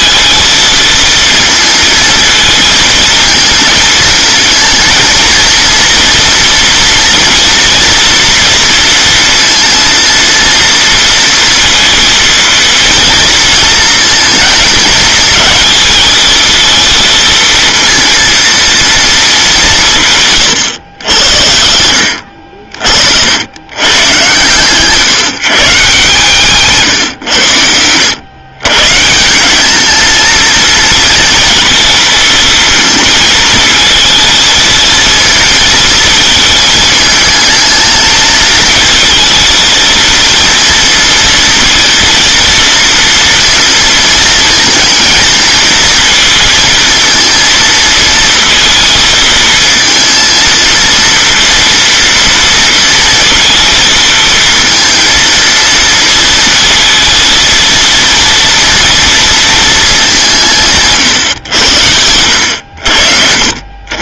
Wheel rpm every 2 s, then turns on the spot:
230, 220, 220, 230, 230, 230, 230, 220, 230, 230, 110, 60, 140, 150, 120, 230, 220, 220, 220, 220, 230, 230, 220, 230, 230, 230, 230, 230, 230, 230, 160, 90.
none